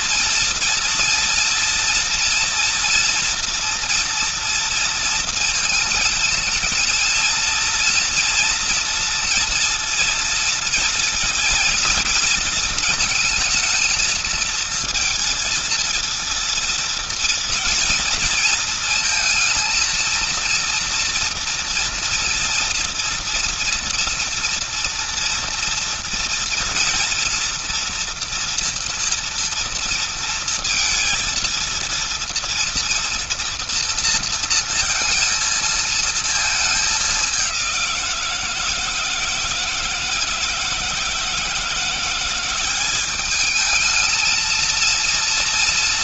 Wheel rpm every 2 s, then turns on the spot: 230, 240, 230, 220, 230, 230, 230, 220, 230, 230, 230, 230, 230, 230, 230, 230, 230, 230, 220, 160, 160, 190, 230.
none